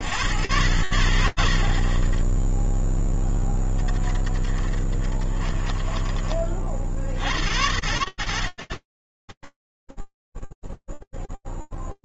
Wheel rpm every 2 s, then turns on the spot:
100, 10, 30, 50, 60, 10.
none